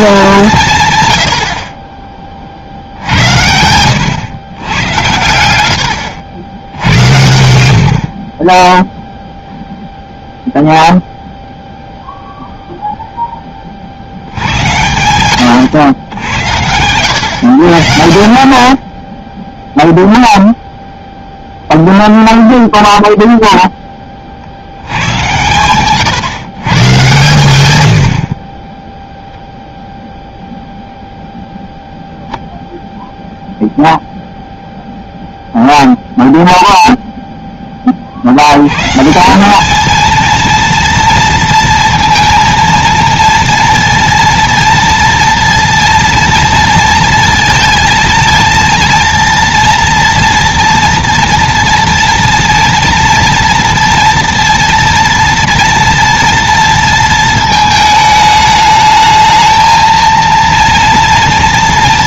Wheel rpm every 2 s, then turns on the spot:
150, 70, 100, 80, 10, 0, 0, 110, 100, 40, 0, 0, 90, 130, 20, 0, 0, 0, 0, 120, 230, 230, 230, 230, 230, 230, 240, 230, 230, 220, 230.
none